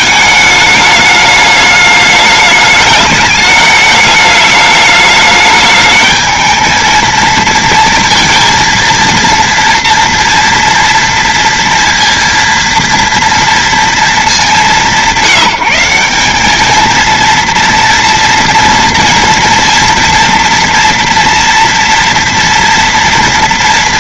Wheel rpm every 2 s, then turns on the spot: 220, 210, 210, 220, 230, 230, 230, 220, 190, 230, 240, 240.
none